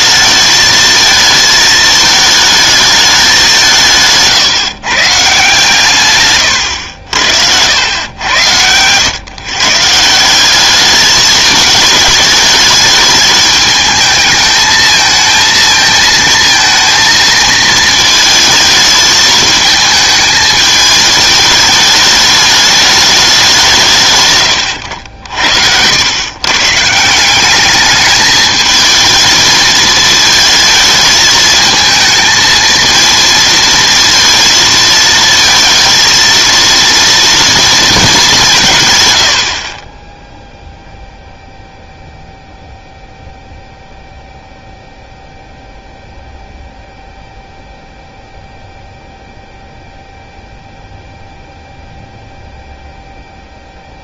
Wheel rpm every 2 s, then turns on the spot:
220, 210, 150, 120, 100, 190, 210, 220, 220, 220, 220, 210, 120, 140, 220, 220, 220, 230, 230, 170, 0, 0, 0, 0, 0, 0, 0.
8-10